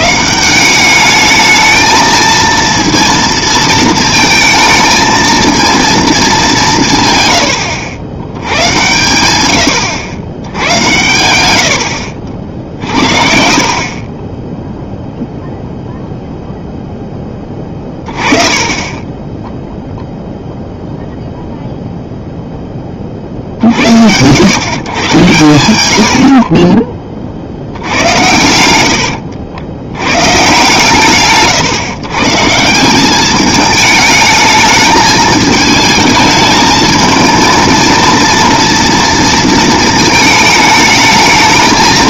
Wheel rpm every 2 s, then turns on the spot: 190, 230, 220, 180, 100, 100, 60, 0, 0, 20, 0, 20, 110, 30, 90, 130, 160, 210, 220, 230, 210.
28-30